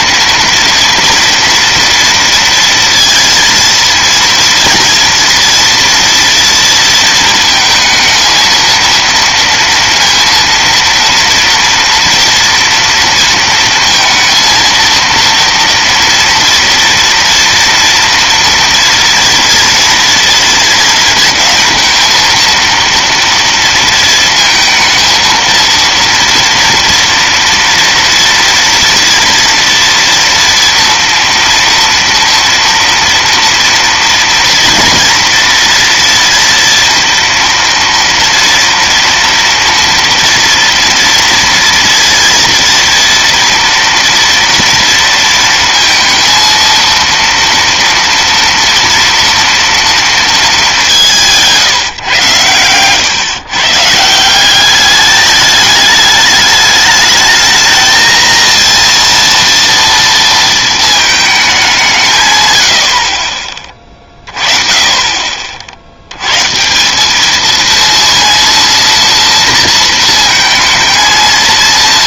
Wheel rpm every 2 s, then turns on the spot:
230, 230, 230, 230, 230, 230, 230, 230, 240, 230, 230, 230, 230, 240, 230, 230, 230, 240, 230, 230, 230, 230, 230, 230, 230, 190, 120, 200, 210, 230, 220, 90, 20, 160, 230, 220.
none